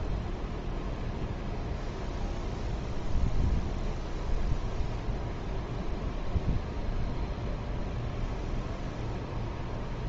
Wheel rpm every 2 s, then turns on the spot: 0, 0, 0, 0, 0.
none